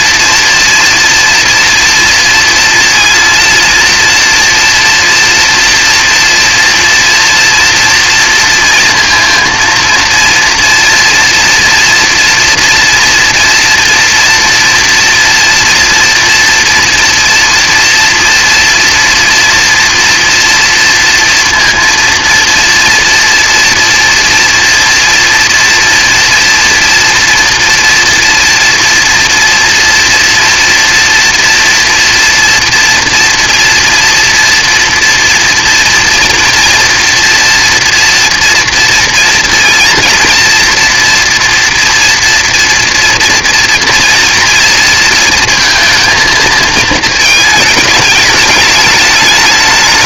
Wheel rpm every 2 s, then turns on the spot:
230, 230, 240, 230, 230, 230, 240, 230, 230, 230, 230, 230, 230, 230, 240, 230, 230, 230, 240, 230, 230, 230, 230, 220, 210.
none